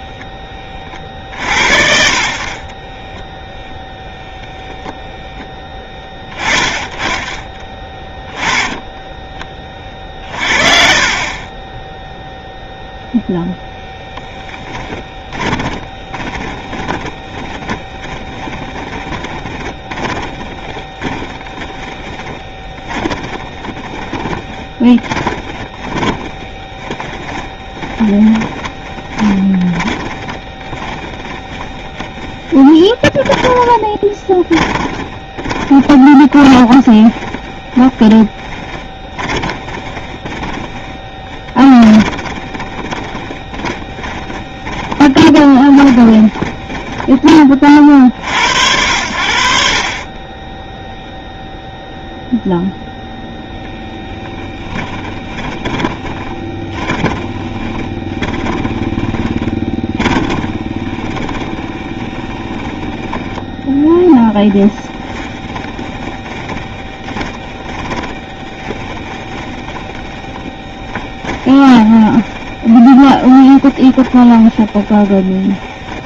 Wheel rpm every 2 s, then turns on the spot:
30, 40, 0, 20, 10, 40, 0, 10, 20, 10, 10, 30, 30, 20, 20, 30, 20, 20, 20, 20, 20, 20, 20, 20, 70, 10, 0, 10, 20, 20, 20, 10, 10, 20, 20, 20, 20, 20.
10-12 14-48 50-52 54-62 64-76